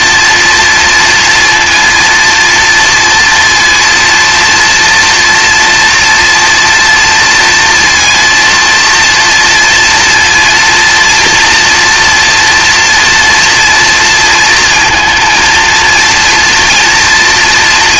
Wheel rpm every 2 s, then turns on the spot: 230, 240, 230, 230, 230, 240, 230, 230, 230.
none